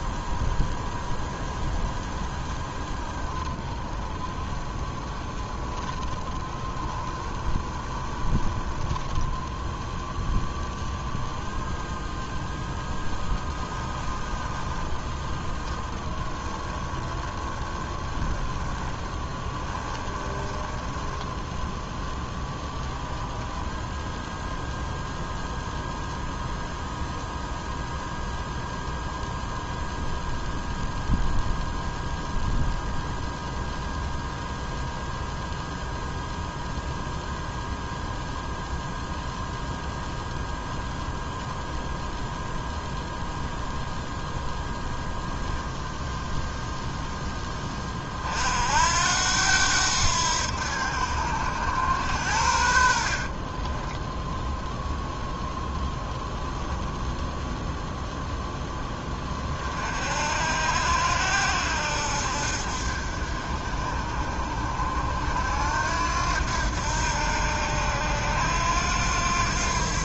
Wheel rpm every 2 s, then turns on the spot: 0, 10, 10, 10, 10, 0, 0, 10, 10, 20, 10, 0, 0, 0, 0, 0, 0, 0, 0, 0, 0, 0, 0, 0, 80, 80, 60, 0, 0, 20, 80, 60, 70, 80, 90.
4-10 14-22 52-54